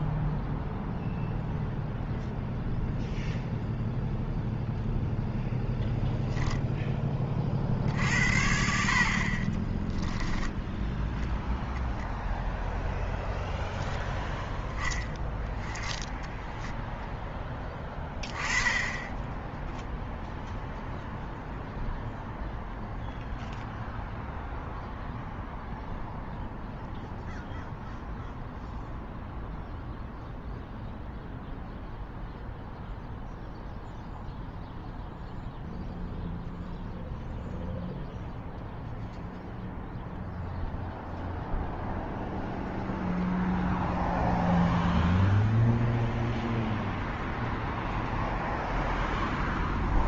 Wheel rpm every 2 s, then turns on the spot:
0, 0, 0, 10, 60, 10, 0, 10, 0, 20, 0, 0, 0, 0, 0, 0, 0, 0, 0, 0, 0, 0, 0, 0, 0.
6-8